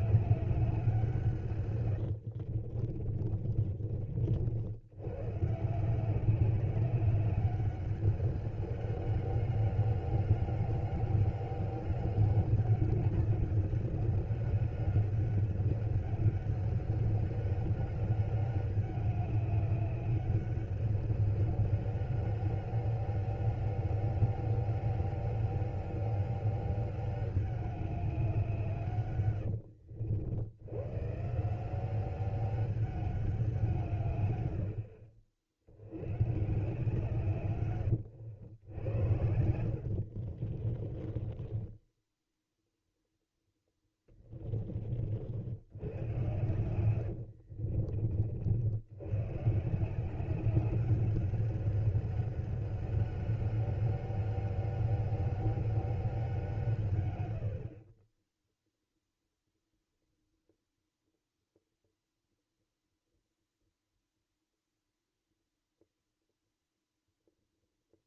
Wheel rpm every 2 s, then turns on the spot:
190, 40, 80, 190, 200, 200, 200, 200, 200, 200, 200, 190, 200, 200, 160, 100, 200, 80, 150, 90, 40, 0, 40, 110, 80, 200, 200, 200, 150, 0, 0, 0, 0, 0.
2-4 40-42 46-48